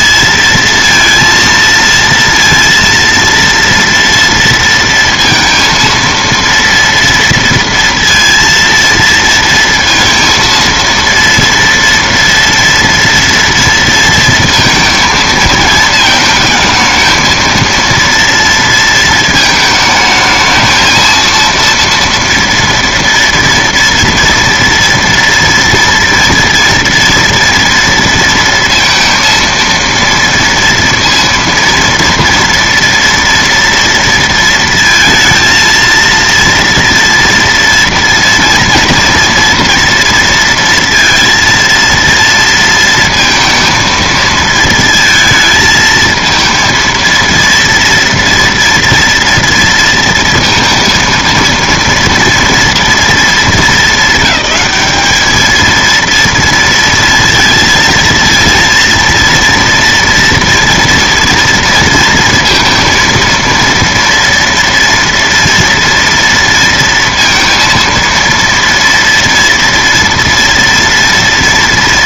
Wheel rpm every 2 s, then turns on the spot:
230, 230, 230, 230, 230, 230, 230, 230, 220, 230, 220, 230, 230, 240, 230, 230, 230, 230, 230, 230, 230, 230, 220, 230, 230, 230, 230, 210, 230, 230, 230, 230, 230, 230, 230, 230.
none